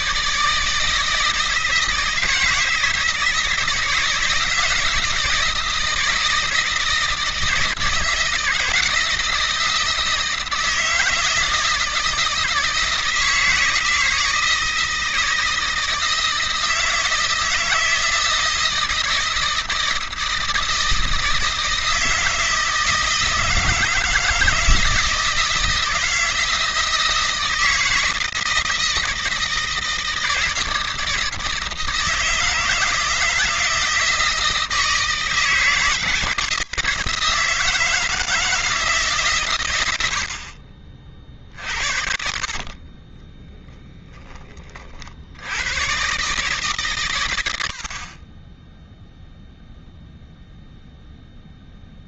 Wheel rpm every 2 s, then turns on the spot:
160, 160, 160, 160, 160, 160, 160, 160, 160, 160, 160, 160, 160, 160, 160, 160, 160, 160, 160, 150, 40, 30, 40, 130, 10, 0.
42-44